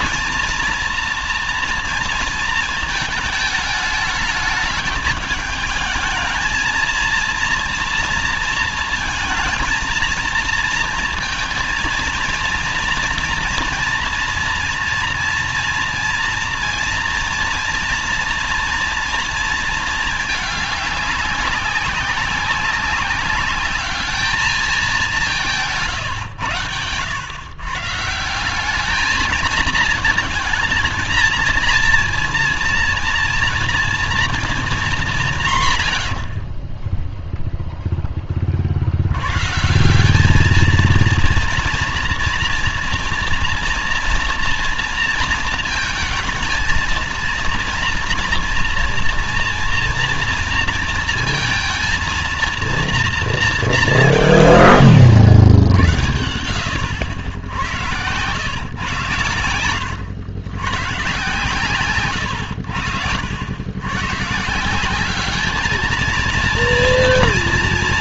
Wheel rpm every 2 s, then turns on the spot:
230, 230, 220, 220, 230, 230, 230, 230, 230, 230, 210, 190, 210, 100, 180, 220, 240, 220, 40, 40, 210, 230, 230, 220, 230, 230, 230, 120, 90, 110, 110, 90, 150, 230.
none